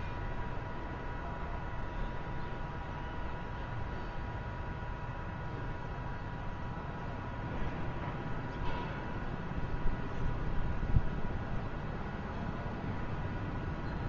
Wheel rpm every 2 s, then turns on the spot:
0, 0, 0, 0, 0, 0, 0.
none